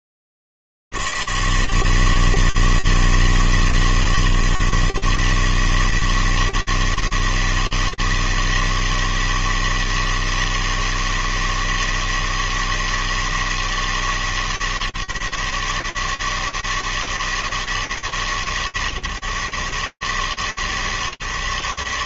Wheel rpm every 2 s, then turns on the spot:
80, 160, 140, 160, 160, 160, 160, 150, 150, 150, 140.
none